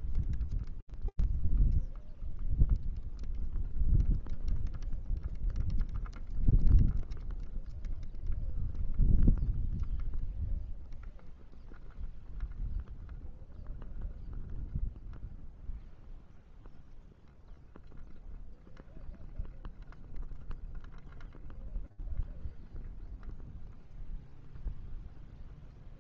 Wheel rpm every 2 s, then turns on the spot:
0, 0, 0, 0, 0, 0, 0, 0, 0, 0, 0, 0, 0.
none